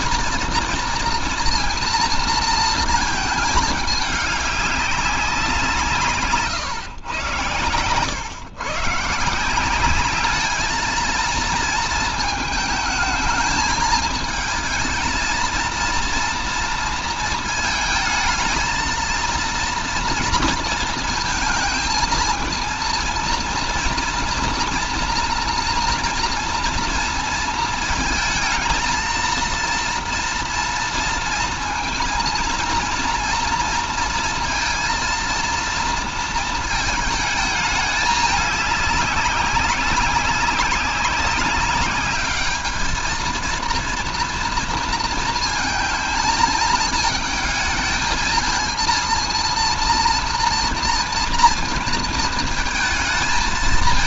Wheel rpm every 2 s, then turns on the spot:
230, 230, 200, 140, 140, 220, 220, 220, 230, 220, 230, 230, 230, 230, 220, 230, 230, 230, 220, 200, 190, 210, 230, 220, 220, 230, 230.
none